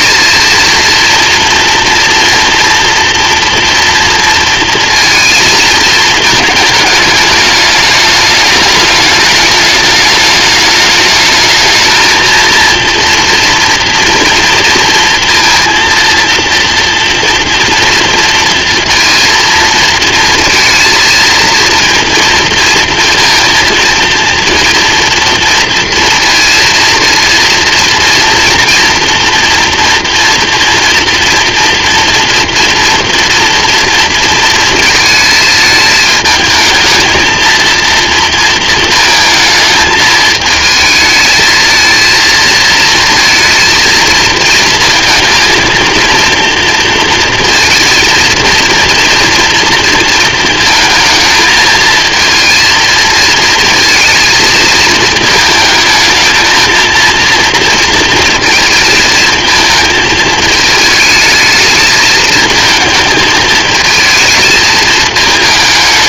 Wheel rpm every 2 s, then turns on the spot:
230, 230, 230, 210, 210, 210, 230, 230, 230, 230, 230, 230, 230, 230, 230, 230, 240, 220, 220, 220, 220, 220, 220, 230, 230, 220, 230, 220, 230, 230, 210, 220, 220.
none